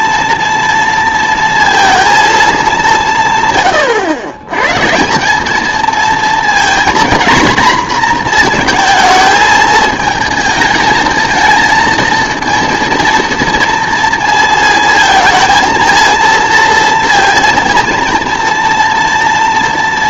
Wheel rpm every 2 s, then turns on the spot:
230, 200, 130, 240, 230, 220, 230, 220, 230, 240.
none